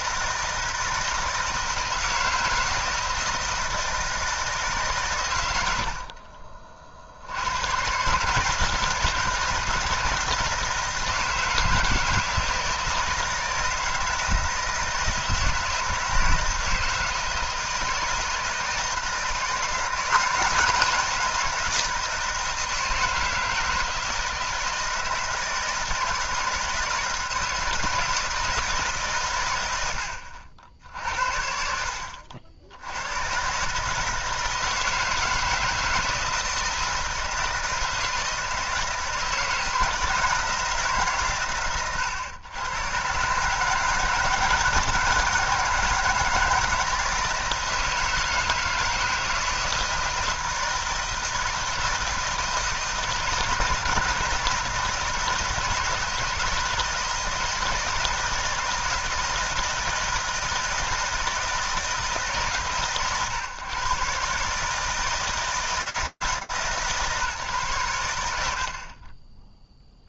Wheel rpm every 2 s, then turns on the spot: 160, 160, 160, 40, 150, 160, 160, 160, 160, 160, 170, 160, 160, 160, 160, 80, 70, 160, 160, 160, 160, 110, 160, 160, 160, 160, 160, 160, 160, 160, 160, 140, 150, 150, 70.
none